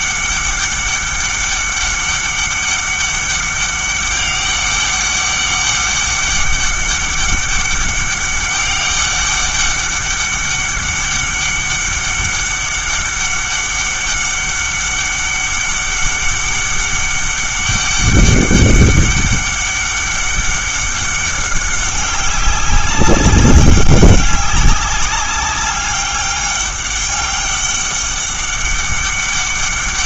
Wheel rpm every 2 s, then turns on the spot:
200, 200, 200, 200, 200, 200, 200, 200, 200, 200, 200, 190, 200, 200, 200.
none